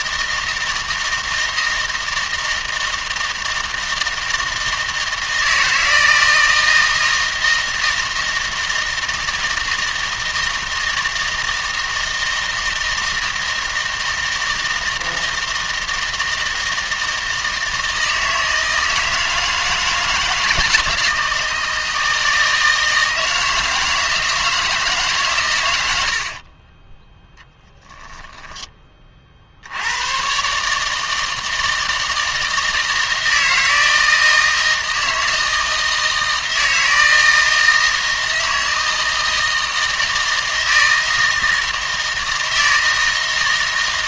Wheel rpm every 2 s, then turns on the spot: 160, 160, 160, 160, 160, 160, 160, 160, 160, 160, 160, 160, 160, 30, 20, 150, 160, 160, 160, 160, 160, 160.
26-28